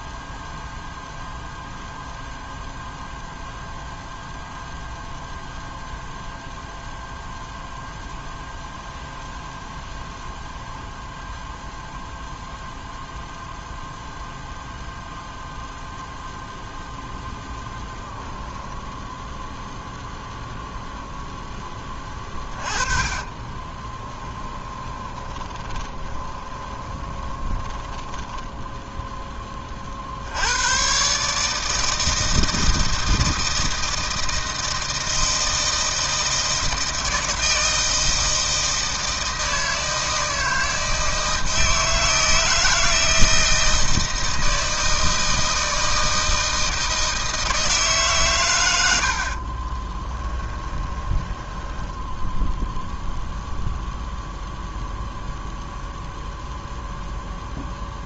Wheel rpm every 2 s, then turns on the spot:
0, 0, 0, 0, 0, 0, 0, 0, 0, 10, 10, 20, 20, 20, 10, 90, 160, 160, 160, 160, 160, 160, 160, 160, 110, 20, 0, 0, 0.
18-20 22-30 50-52